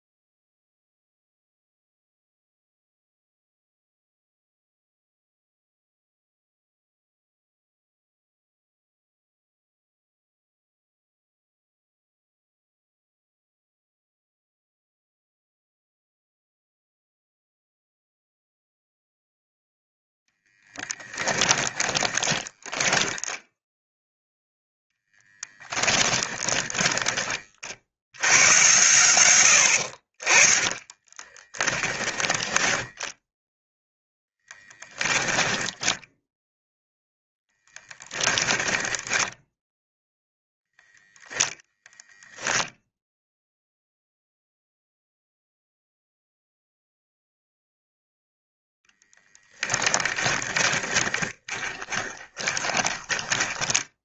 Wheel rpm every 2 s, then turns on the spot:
0, 0, 0, 0, 0, 0, 0, 0, 0, 0, 10, 10, 0, 10, 110, 20, 10, 10, 10, 10, 0, 0, 0, 0, 10, 20, 20.
20-24 26-28 30-32 38-40 50-54